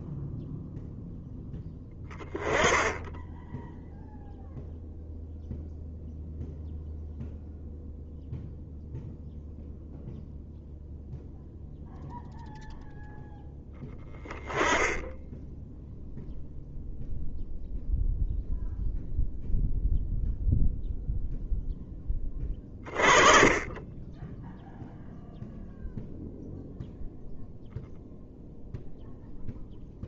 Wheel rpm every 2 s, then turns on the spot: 0, 10, 0, 0, 0, 0, 0, 20, 0, 0, 0, 30, 0, 0, 0.
none